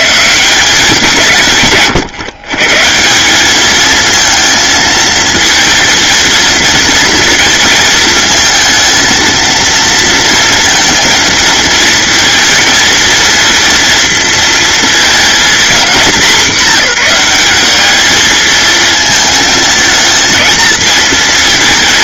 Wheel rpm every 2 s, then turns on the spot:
170, 160, 220, 230, 230, 230, 230, 230, 200, 220, 220.
none